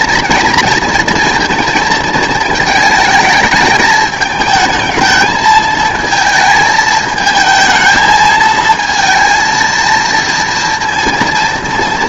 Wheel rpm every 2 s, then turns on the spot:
230, 220, 220, 220, 220, 230.
none